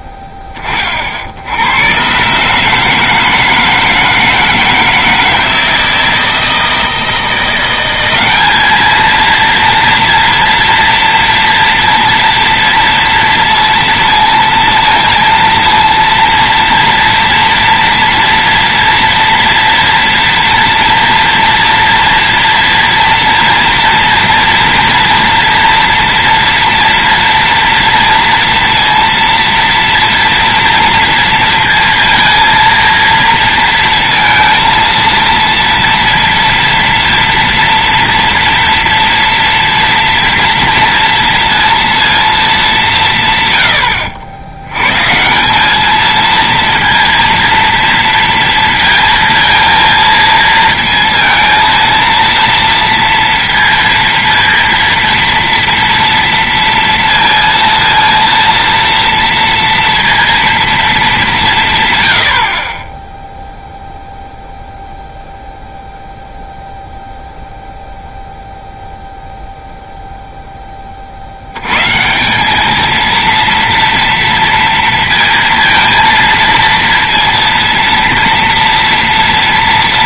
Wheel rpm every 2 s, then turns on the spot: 20, 150, 160, 160, 220, 240, 230, 230, 230, 230, 230, 230, 230, 230, 230, 230, 230, 230, 230, 230, 230, 170, 110, 230, 230, 230, 230, 230, 230, 230, 220, 20, 0, 0, 0, 10, 210, 230, 230, 230.
none